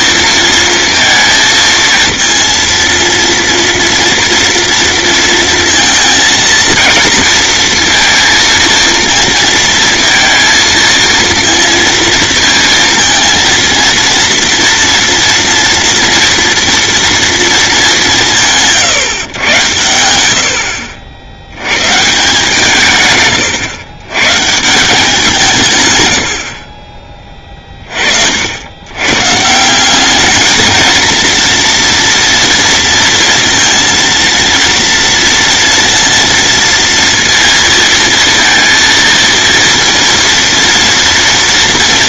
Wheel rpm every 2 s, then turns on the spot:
220, 230, 230, 220, 230, 230, 220, 230, 230, 130, 60, 140, 170, 30, 110, 220, 230, 230, 230, 220, 230.
none